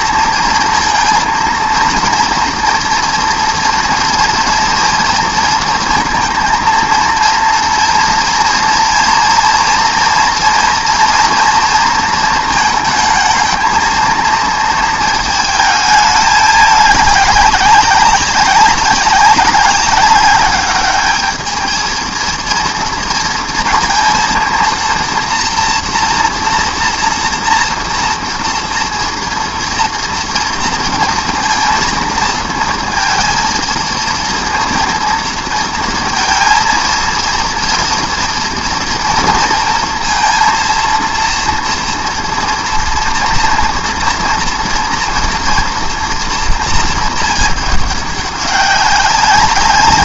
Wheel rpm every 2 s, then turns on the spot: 230, 230, 230, 220, 230, 240, 220, 220, 210, 200, 210, 230, 230, 230, 230, 230, 230, 230, 230, 240, 230, 230, 230, 230, 200.
none